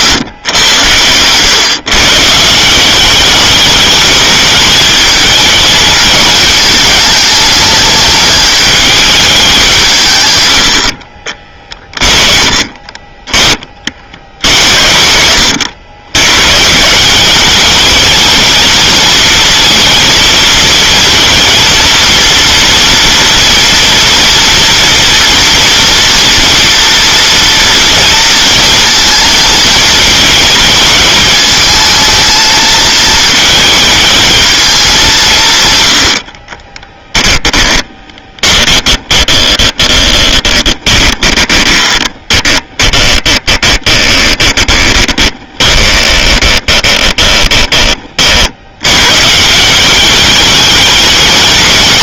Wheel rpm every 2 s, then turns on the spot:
110, 190, 210, 210, 210, 60, 30, 60, 170, 230, 230, 230, 230, 230, 230, 220, 220, 200, 20, 20, 20, 20, 20, 20, 100, 210.
0-2 10-12 36-48